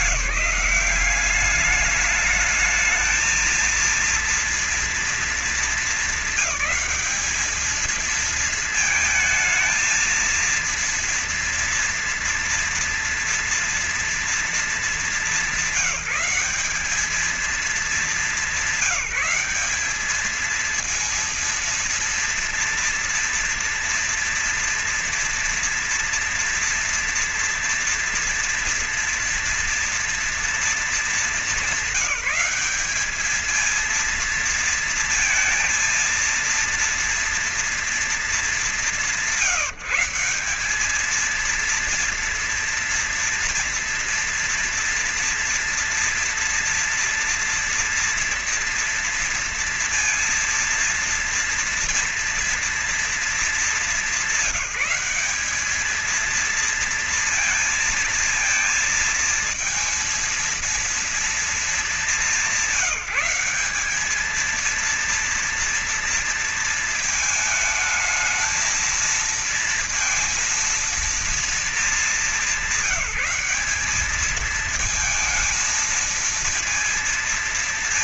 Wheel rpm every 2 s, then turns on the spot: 180, 210, 240, 200, 220, 230, 240, 220, 200, 200, 220, 230, 230, 230, 230, 230, 210, 230, 230, 200, 190, 230, 230, 230, 230, 230, 230, 190, 230, 220, 230, 190, 220, 230, 220, 230, 200, 220, 230.
none